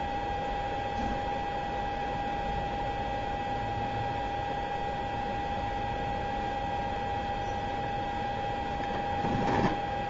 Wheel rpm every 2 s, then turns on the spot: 0, 0, 0, 0, 0.
none